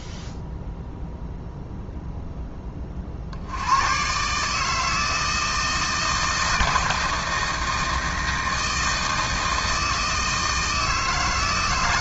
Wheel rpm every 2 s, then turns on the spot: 0, 30, 160, 160, 160, 160.
none